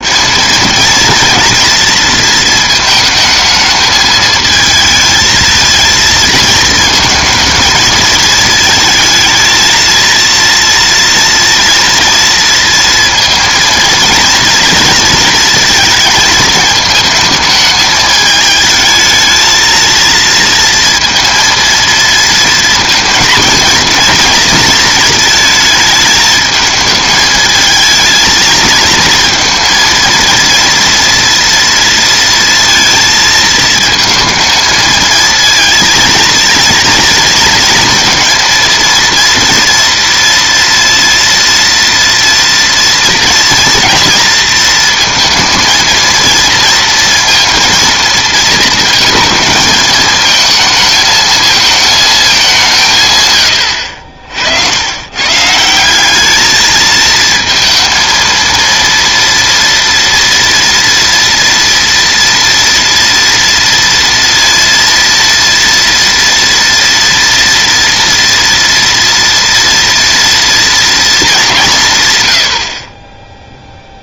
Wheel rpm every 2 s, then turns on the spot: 230, 220, 220, 220, 220, 230, 230, 230, 220, 220, 230, 230, 230, 220, 230, 230, 230, 220, 230, 230, 230, 230, 230, 230, 230, 220, 170, 90, 220, 230, 230, 230, 230, 230, 230, 230, 70.
none